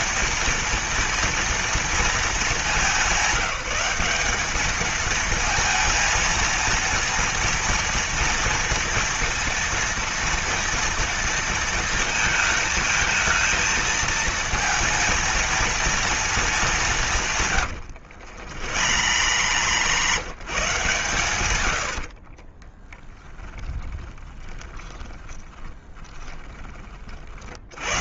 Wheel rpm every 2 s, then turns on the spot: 230, 210, 220, 230, 230, 230, 230, 230, 170, 100, 130, 10, 20, 50.
18-20 22-26